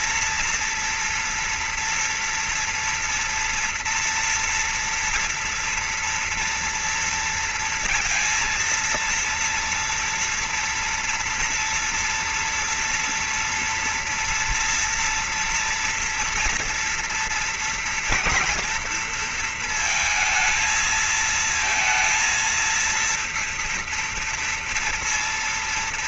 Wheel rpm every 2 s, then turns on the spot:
230, 240, 230, 240, 230, 230, 230, 240, 230, 230, 220, 230, 230.
none